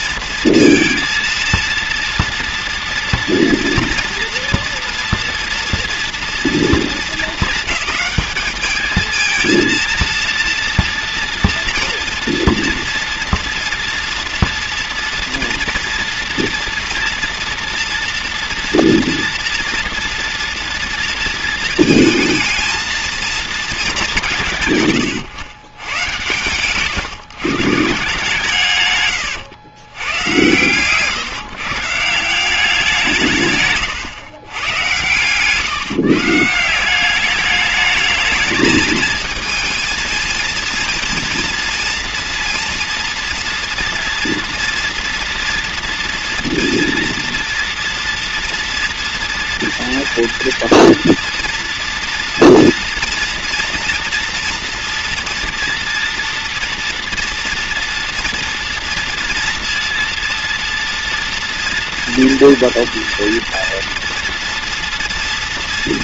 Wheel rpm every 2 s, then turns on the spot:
230, 230, 240, 230, 210, 230, 240, 240, 240, 240, 240, 230, 150, 120, 150, 120, 180, 110, 160, 220, 220, 230, 240, 230, 230, 230, 230, 230, 230, 230, 230, 230, 240.
none